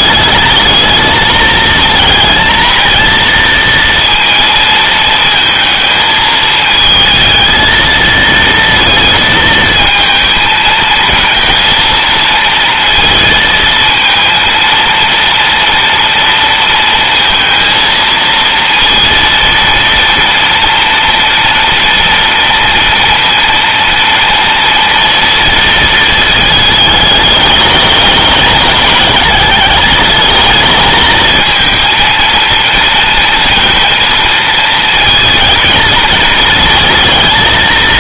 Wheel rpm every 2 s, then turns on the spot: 220, 230, 230, 220, 230, 220, 230, 230, 230, 230, 230, 230, 230, 210, 210, 220, 230, 220, 230.
none